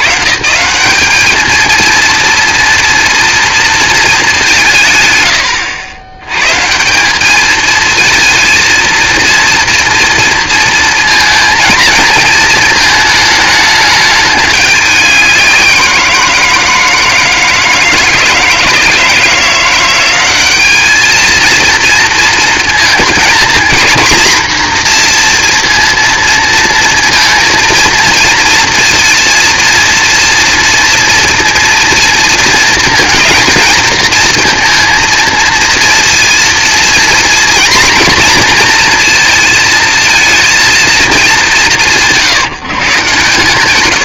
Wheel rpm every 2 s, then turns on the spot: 130, 240, 170, 150, 230, 230, 220, 200, 170, 160, 200, 230, 240, 230, 240, 230, 220, 230, 230, 240, 230, 160.
none